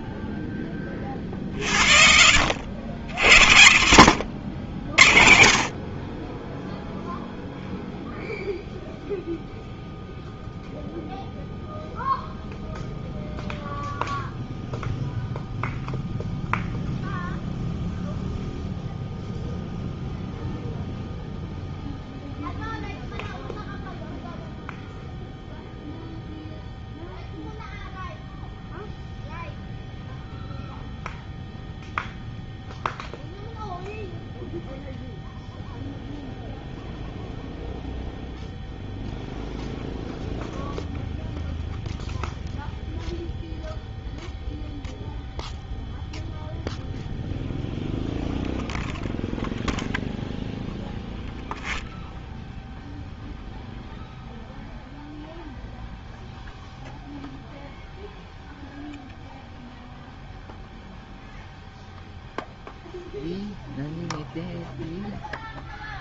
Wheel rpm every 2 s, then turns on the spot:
20, 70, 80, 20, 0, 0, 0, 0, 0, 0, 0, 0, 0, 0, 0, 0, 0, 0, 0, 0, 0, 0, 0, 0, 0, 0, 0, 0, 0, 0, 0, 0, 0.
none